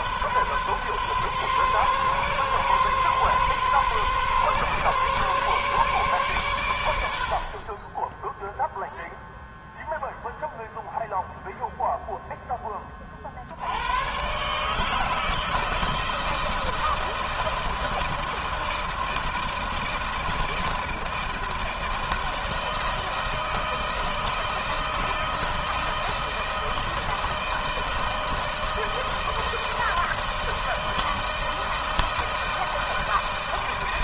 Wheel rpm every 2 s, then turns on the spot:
130, 140, 140, 120, 10, 0, 10, 130, 160, 160, 170, 160, 160, 160, 160, 160, 160.
none